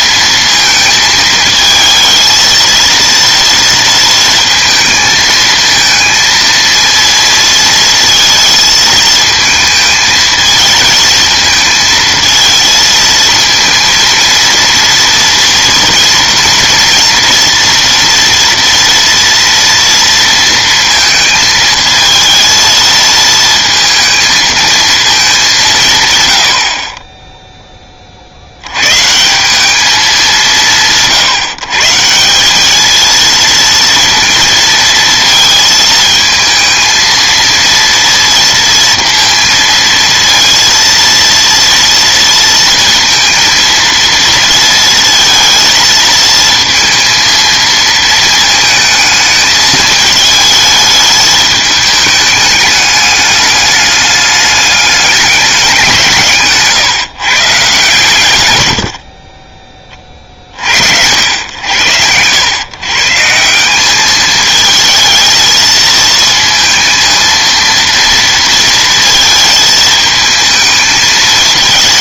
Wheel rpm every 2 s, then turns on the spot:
230, 230, 230, 230, 220, 220, 220, 230, 230, 230, 230, 220, 230, 40, 110, 160, 210, 230, 220, 230, 230, 230, 230, 230, 220, 220, 210, 210, 150, 80, 70, 120, 220, 230, 230, 220.
none